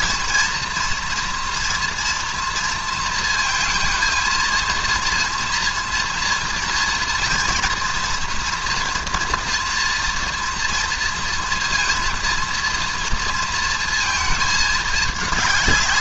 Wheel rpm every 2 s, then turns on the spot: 230, 230, 220, 230, 230, 230, 230, 220.
none